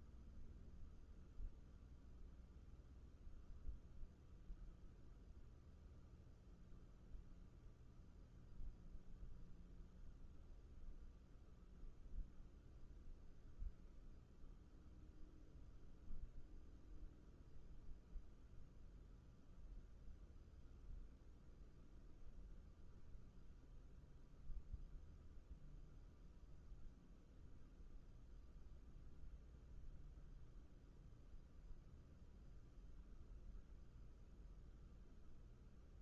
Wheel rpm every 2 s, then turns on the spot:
0, 0, 0, 0, 0, 0, 0, 0, 0, 0, 0, 0, 0, 0, 0, 0, 0, 0.
none